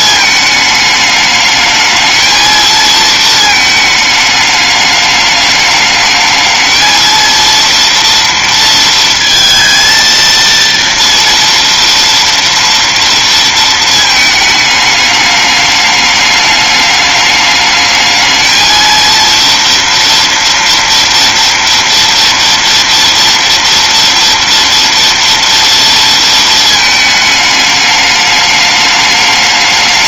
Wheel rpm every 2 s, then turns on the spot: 210, 220, 210, 230, 230, 230, 230, 210, 210, 230, 230, 230, 230, 220, 210.
none